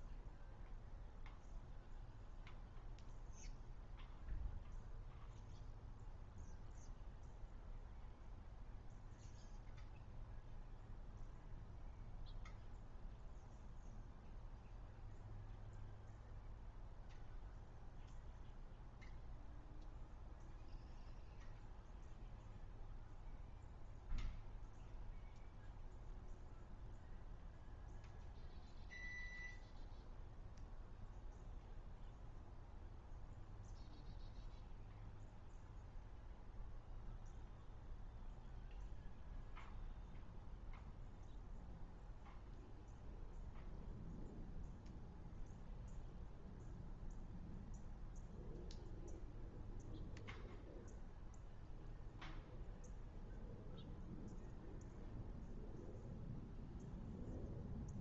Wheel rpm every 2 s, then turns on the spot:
0, 0, 0, 0, 0, 0, 0, 0, 0, 0, 0, 0, 0, 0, 0, 0, 0, 0, 0, 0, 0, 0, 0, 0, 0, 0, 0, 0, 0.
none